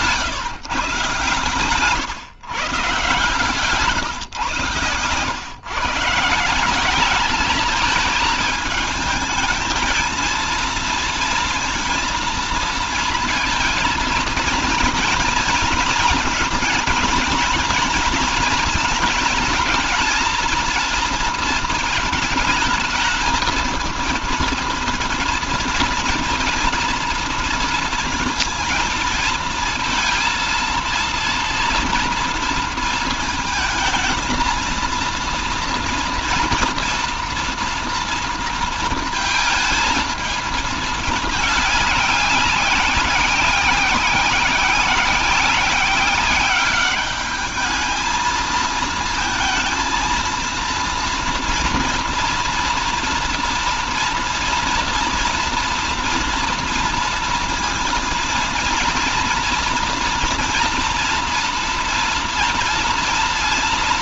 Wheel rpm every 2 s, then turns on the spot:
150, 140, 130, 190, 220, 230, 230, 230, 230, 220, 230, 220, 230, 240, 230, 230, 230, 230, 230, 230, 220, 190, 190, 200, 220, 230, 230, 230, 230, 230, 230, 230.
none